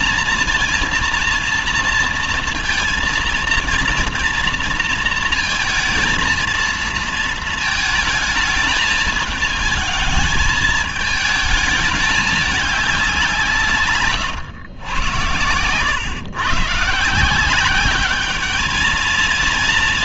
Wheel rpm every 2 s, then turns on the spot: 230, 230, 230, 230, 220, 220, 200, 110, 130, 210.
none